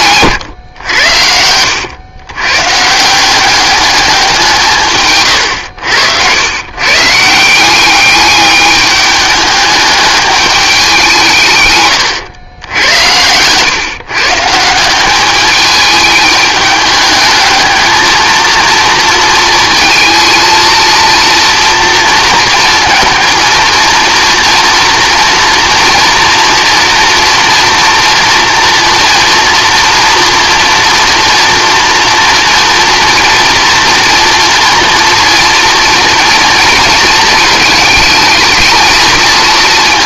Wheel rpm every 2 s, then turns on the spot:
120, 130, 150, 120, 210, 200, 100, 170, 210, 230, 230, 230, 230, 230, 230, 230, 230, 230, 230, 220.
none